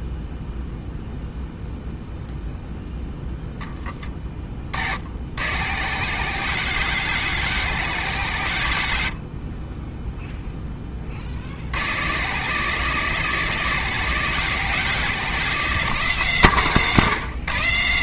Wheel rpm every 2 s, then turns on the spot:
0, 0, 50, 150, 110, 10, 150, 160, 140.
none